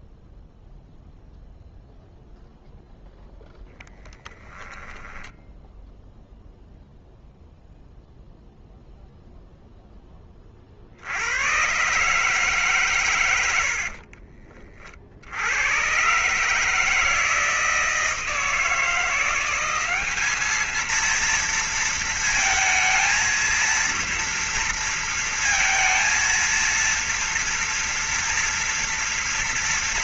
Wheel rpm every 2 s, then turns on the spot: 0, 0, 0, 0, 0, 40, 140, 50, 150, 170, 220, 220, 230, 230, 230.
none